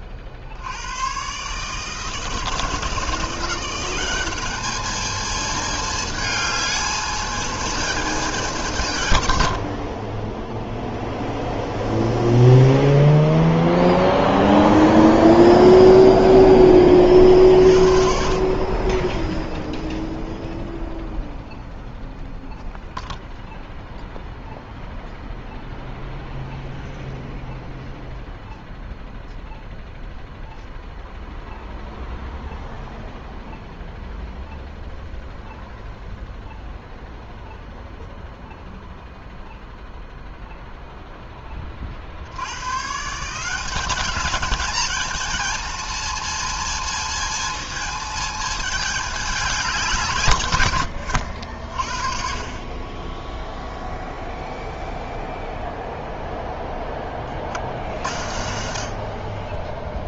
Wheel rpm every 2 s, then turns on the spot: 80, 160, 210, 220, 190, 0, 0, 0, 10, 30, 0, 0, 0, 0, 0, 0, 0, 0, 0, 0, 0, 100, 220, 230, 220, 110, 30, 0, 0, 90.
18-20